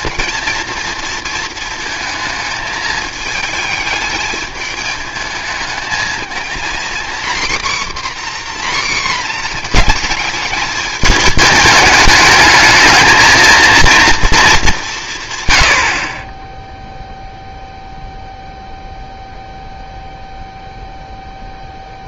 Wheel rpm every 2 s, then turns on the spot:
230, 220, 220, 240, 260, 210, 210, 190, 0, 0, 0.
none